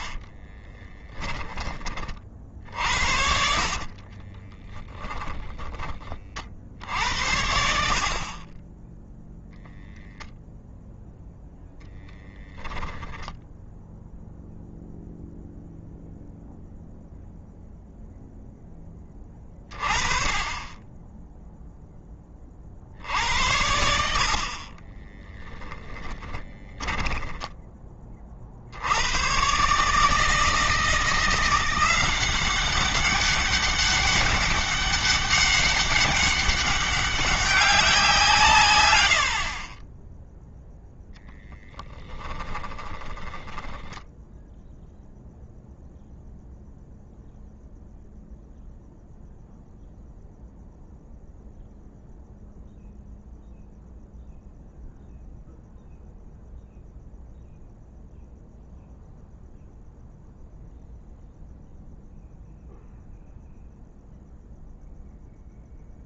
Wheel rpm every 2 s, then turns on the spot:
20, 70, 20, 70, 10, 0, 10, 0, 0, 20, 20, 60, 40, 20, 80, 160, 190, 200, 200, 110, 0, 10, 0, 0, 0, 0, 0, 0, 0, 0, 0, 0, 0.
0-6 24-28 42-44